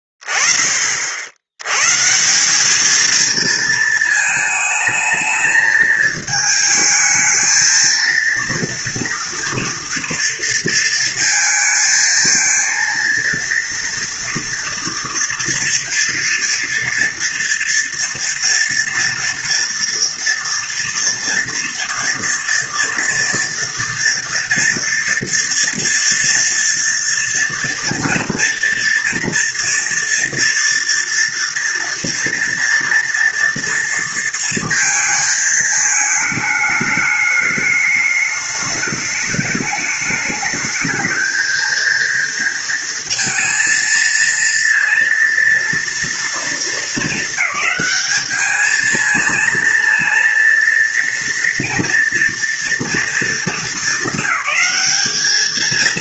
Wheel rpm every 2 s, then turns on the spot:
20, 190, 220, 220, 230, 230, 220, 230, 240, 230, 230, 230, 230, 230, 230, 230, 230, 230, 220, 210, 210, 230, 230, 230, 210, 230, 230, 210.
none